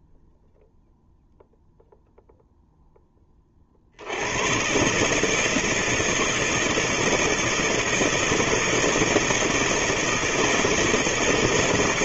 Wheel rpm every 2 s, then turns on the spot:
0, 0, 110, 160, 160, 160.
none